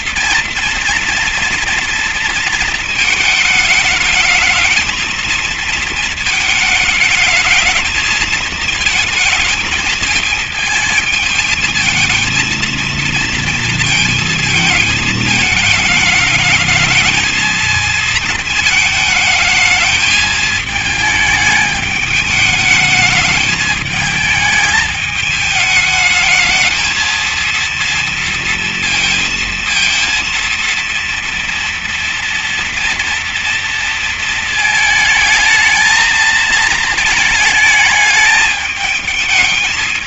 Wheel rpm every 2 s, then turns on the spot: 230, 230, 220, 220, 220, 220, 220, 230, 220, 220, 220, 210, 220, 220, 230, 230, 230, 220, 220, 210.
none